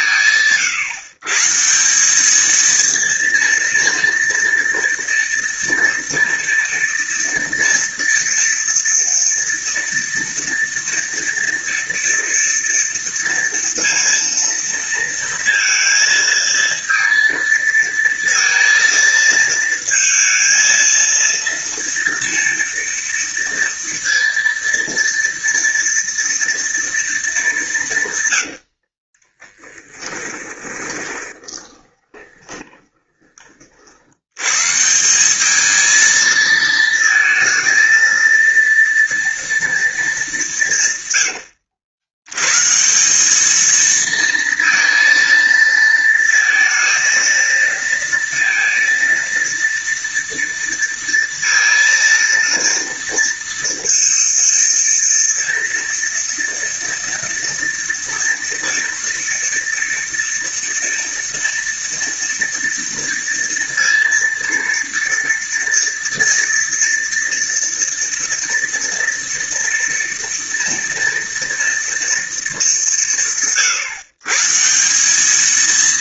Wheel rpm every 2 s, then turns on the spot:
140, 230, 230, 240, 230, 230, 230, 230, 230, 230, 230, 230, 230, 200, 20, 20, 30, 190, 230, 230, 110, 200, 230, 230, 230, 230, 230, 230, 230, 230, 230, 230, 230, 230, 230, 230, 160, 210.
28-32